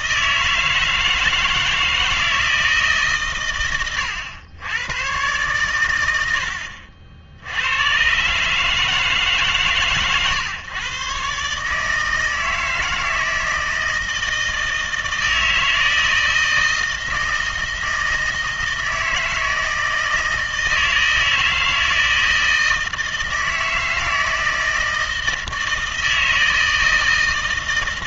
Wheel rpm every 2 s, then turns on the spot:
160, 150, 110, 70, 150, 130, 160, 160, 160, 160, 160, 160, 160, 160.
none